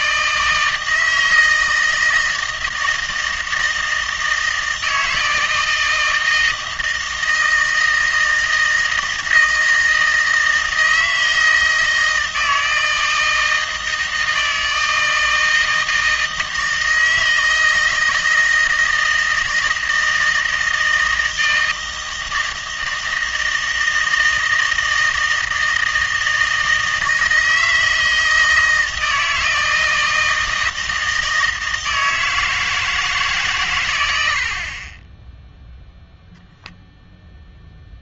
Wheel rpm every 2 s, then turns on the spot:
160, 160, 160, 160, 160, 160, 160, 160, 160, 160, 160, 160, 160, 160, 160, 160, 160, 40, 0.
none